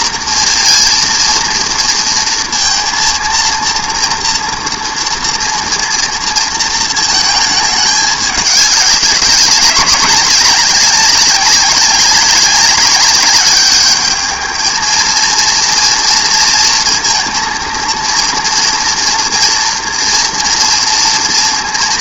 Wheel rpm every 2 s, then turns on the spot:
230, 230, 240, 230, 200, 190, 200, 220, 230, 230, 230.
none